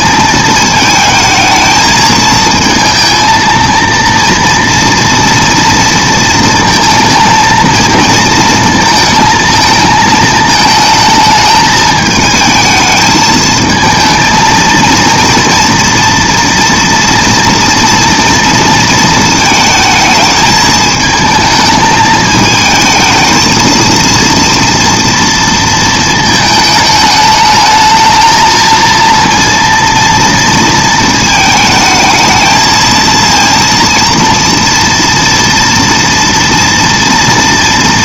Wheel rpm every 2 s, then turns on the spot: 220, 230, 230, 220, 230, 220, 220, 230, 230, 230, 220, 220, 230, 220, 230, 230, 230, 230, 230.
none